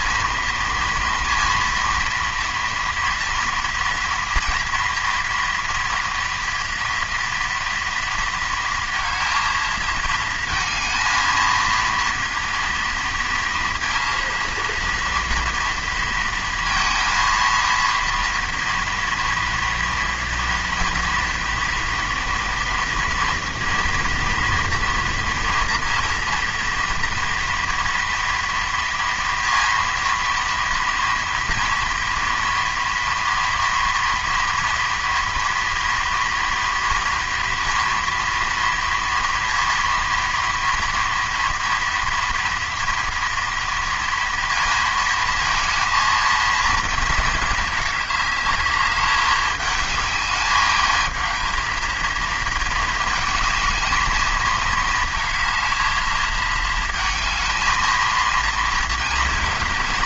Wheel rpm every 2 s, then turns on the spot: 230, 230, 230, 230, 230, 230, 230, 230, 230, 230, 230, 240, 230, 230, 230, 230, 230, 230, 230, 230, 230, 230, 230, 230, 210, 210, 220, 220, 230, 230.
none